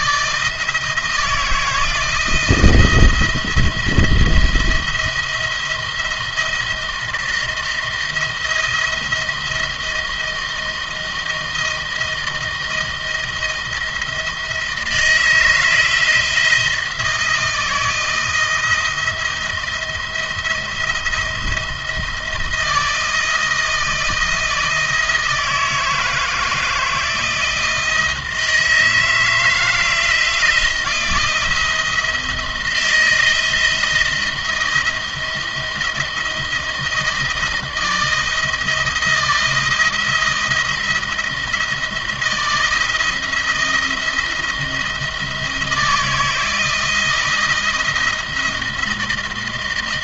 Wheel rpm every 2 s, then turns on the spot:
160, 170, 170, 170, 170, 170, 160, 170, 170, 170, 160, 160, 160, 160, 160, 170, 160, 170, 160, 170, 170, 160, 170, 160, 170.
none